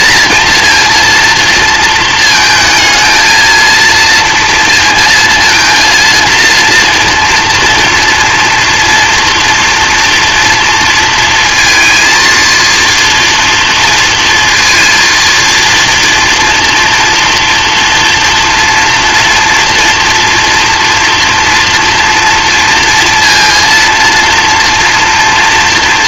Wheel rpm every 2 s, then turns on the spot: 230, 220, 230, 230, 230, 230, 230, 230, 230, 230, 230, 230, 230.
none